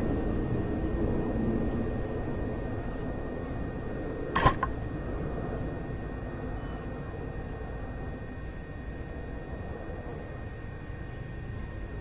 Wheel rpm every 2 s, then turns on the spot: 0, 0, 0, 0, 0, 0.
none